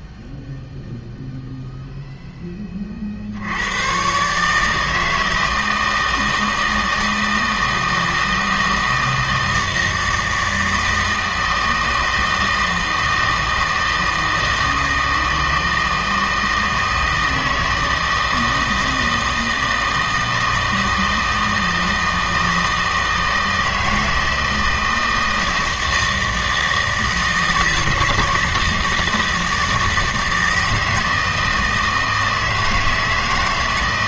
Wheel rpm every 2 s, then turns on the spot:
0, 20, 160, 160, 160, 160, 160, 160, 160, 160, 160, 160, 160, 160, 160, 160, 160.
none